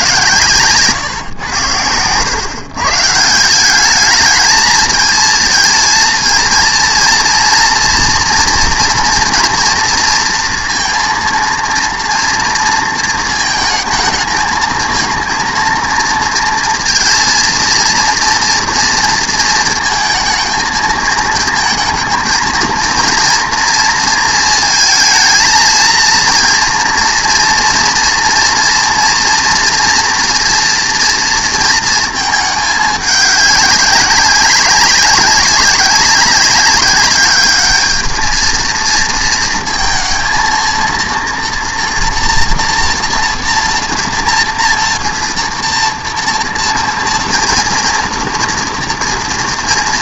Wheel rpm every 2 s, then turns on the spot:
140, 130, 220, 230, 230, 230, 230, 220, 230, 230, 220, 230, 230, 230, 230, 230, 210, 190, 200, 220, 230, 230, 240, 240, 230.
none